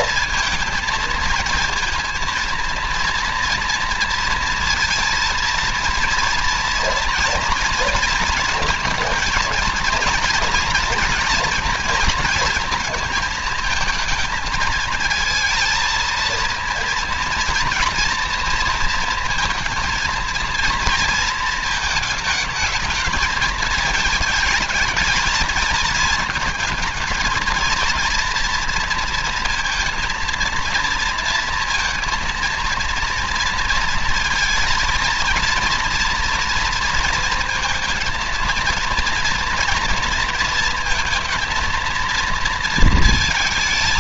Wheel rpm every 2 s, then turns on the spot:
230, 230, 230, 230, 230, 230, 230, 220, 230, 230, 230, 220, 220, 220, 230, 230, 230, 230, 230, 230, 230, 230.
none